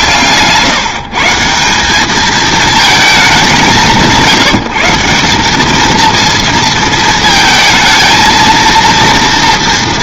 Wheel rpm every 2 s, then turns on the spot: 150, 220, 170, 230, 230.
none